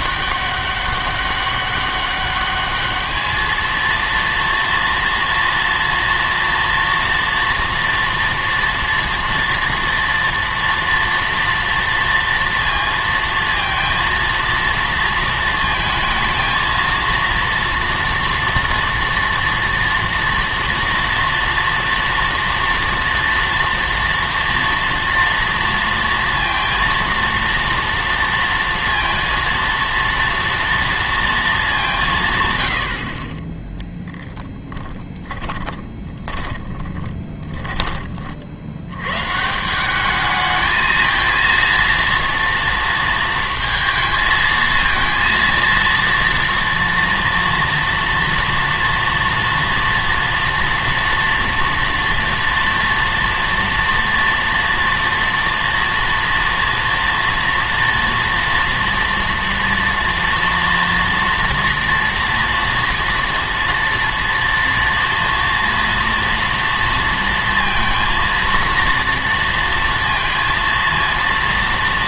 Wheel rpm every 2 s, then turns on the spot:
200, 210, 230, 230, 230, 230, 230, 230, 220, 230, 230, 240, 230, 230, 230, 230, 100, 10, 20, 70, 220, 230, 220, 230, 230, 230, 230, 230, 230, 230, 230, 240, 240, 230, 230, 230.
34-38